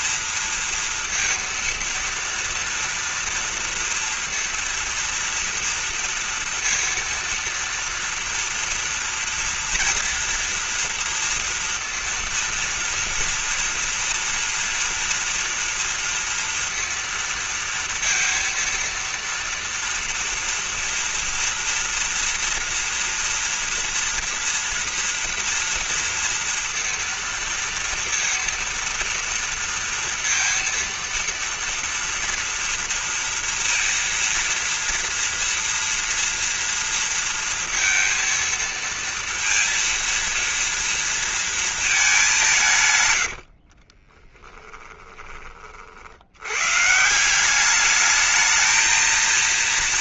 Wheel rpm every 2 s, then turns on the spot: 230, 230, 230, 230, 230, 230, 230, 230, 230, 230, 230, 230, 230, 230, 230, 230, 230, 230, 230, 230, 230, 150, 20, 120, 220.
44-46